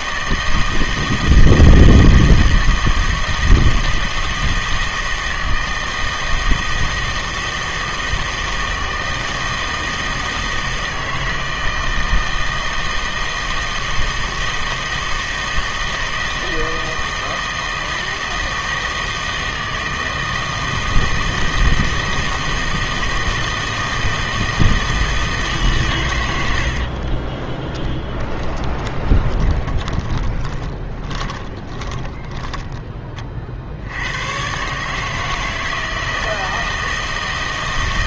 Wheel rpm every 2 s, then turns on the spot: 160, 160, 160, 160, 160, 160, 160, 160, 160, 160, 160, 160, 160, 70, 20, 20, 10, 120, 160.
26-34